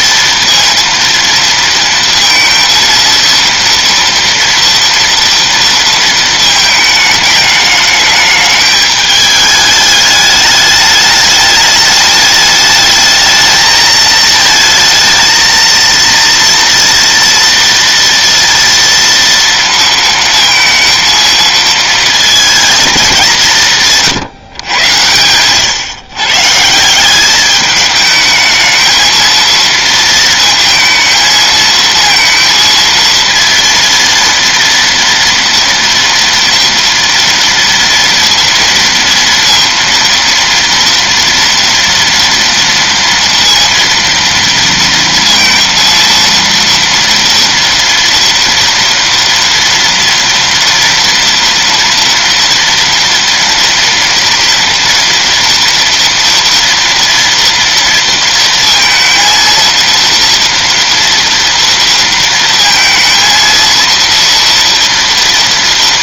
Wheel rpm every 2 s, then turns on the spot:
230, 230, 240, 220, 210, 210, 210, 220, 230, 230, 230, 230, 120, 150, 220, 230, 230, 230, 230, 230, 230, 230, 230, 230, 230, 230, 230, 230, 230, 230, 230, 230, 230.
none